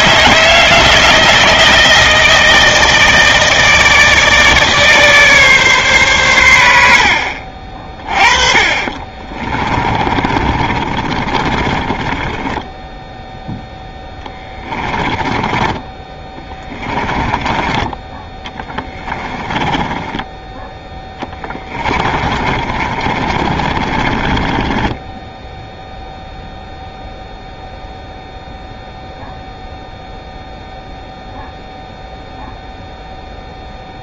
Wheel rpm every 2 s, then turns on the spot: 160, 160, 150, 80, 30, 30, 10, 20, 10, 10, 10, 30, 20, 0, 0, 0, 0.
8-12 14-20 22-26